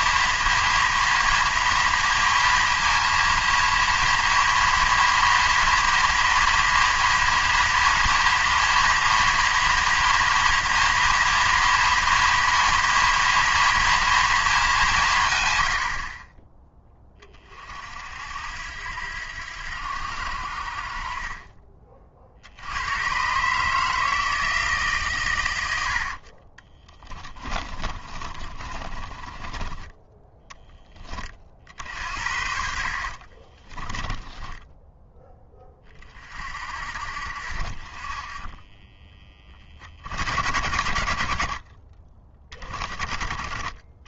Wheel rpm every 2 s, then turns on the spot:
230, 230, 230, 230, 230, 240, 230, 190, 20, 80, 60, 100, 150, 20, 30, 20, 60, 10, 60, 20, 70, 20.
26-30 32-34